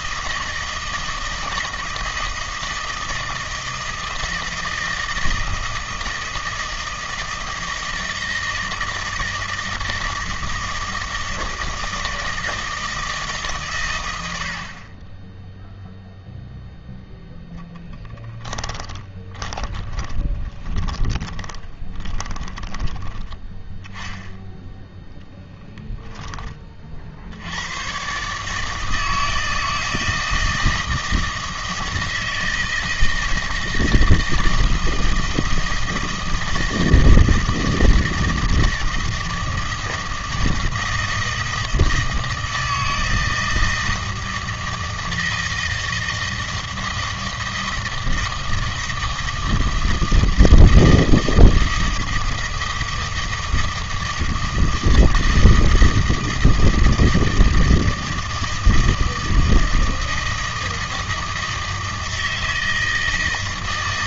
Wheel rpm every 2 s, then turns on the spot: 160, 160, 160, 160, 160, 160, 160, 50, 0, 20, 20, 20, 10, 40, 150, 160, 160, 160, 160, 160, 160, 160, 160, 160, 160, 160, 160, 160, 160, 160, 160, 160.
18-24